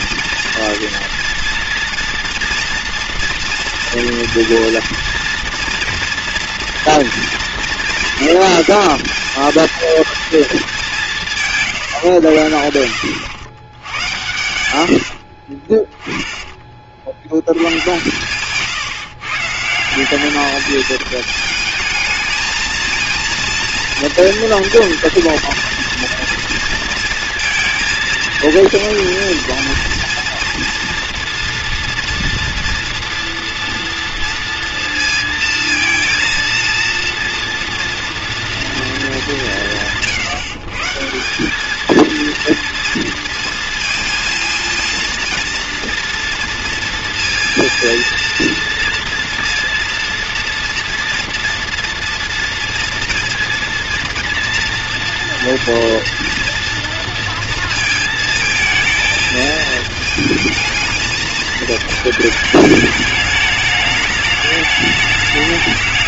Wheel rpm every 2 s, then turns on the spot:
230, 230, 230, 240, 220, 220, 80, 100, 30, 140, 210, 220, 230, 230, 220, 230, 230, 230, 230, 230, 150, 230, 230, 230, 230, 230, 230, 230, 230, 220, 220, 210, 210.
14-16